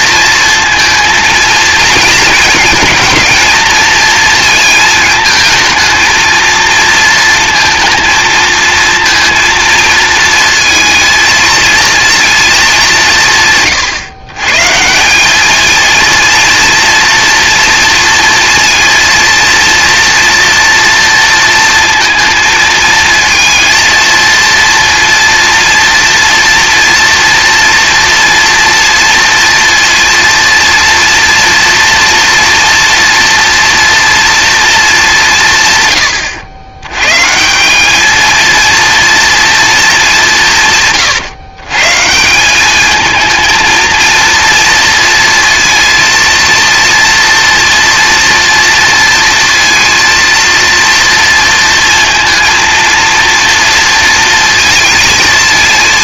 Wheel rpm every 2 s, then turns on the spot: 230, 230, 230, 230, 230, 230, 210, 140, 230, 230, 230, 230, 230, 230, 230, 230, 230, 230, 100, 230, 170, 190, 230, 230, 230, 230, 230, 230.
none